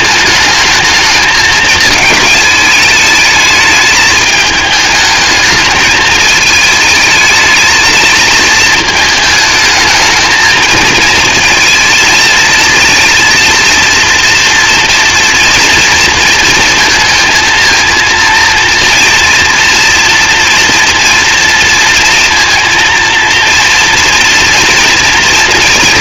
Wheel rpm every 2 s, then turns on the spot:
220, 220, 220, 220, 220, 220, 220, 230, 230, 230, 230, 230, 230.
none